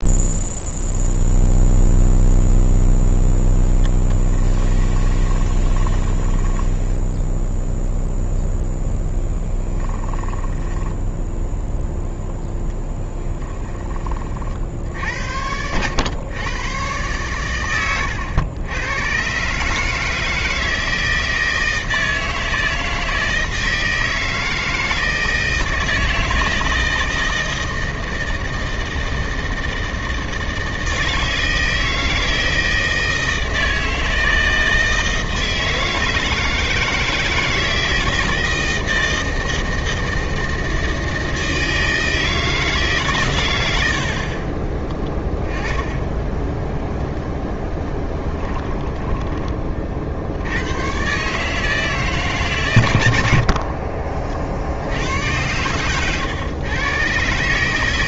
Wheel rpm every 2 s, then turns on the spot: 0, 0, 20, 10, 10, 10, 10, 60, 120, 110, 160, 160, 160, 160, 160, 160, 160, 160, 160, 160, 160, 150, 20, 10, 10, 110, 110, 80, 120.
4-8 10-14 48-50